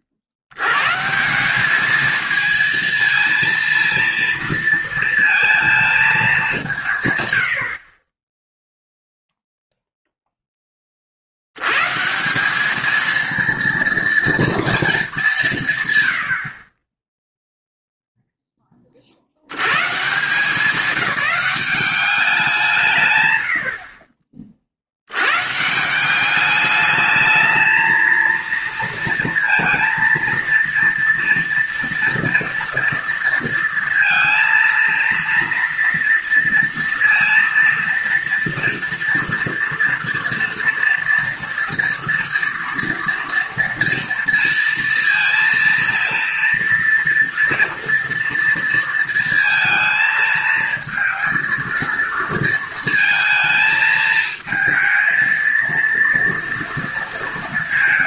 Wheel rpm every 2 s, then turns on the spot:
80, 220, 220, 180, 0, 20, 200, 230, 50, 20, 200, 170, 50, 210, 230, 230, 230, 230, 230, 230, 230, 230, 230, 230, 230, 220, 230, 220, 230.
none